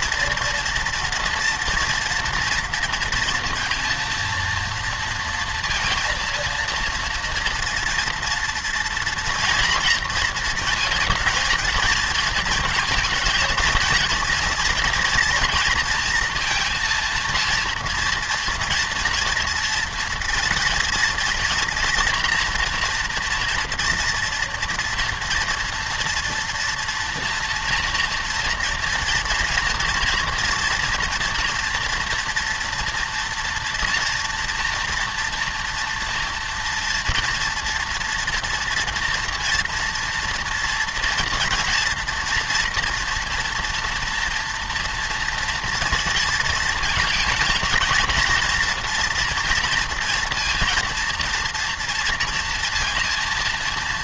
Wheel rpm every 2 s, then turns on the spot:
230, 230, 230, 230, 230, 230, 230, 230, 230, 240, 230, 230, 240, 230, 230, 230, 230, 230, 230, 240, 230, 230, 230, 230, 230, 230, 230.
none